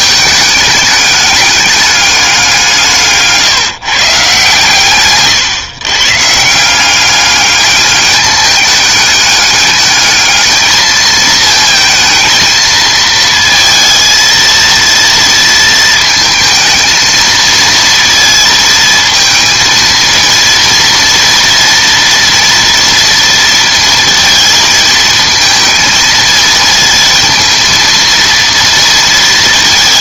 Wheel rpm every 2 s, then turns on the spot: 210, 160, 130, 180, 200, 220, 220, 230, 220, 230, 230, 230, 220, 220, 230.
none